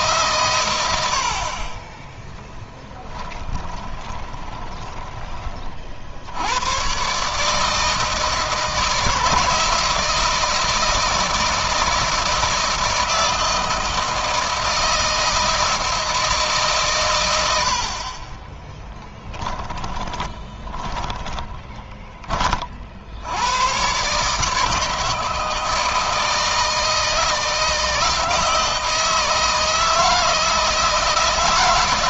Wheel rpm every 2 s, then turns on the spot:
90, 20, 20, 120, 150, 160, 160, 160, 140, 10, 20, 60, 150, 160, 160, 160.
2-6 18-22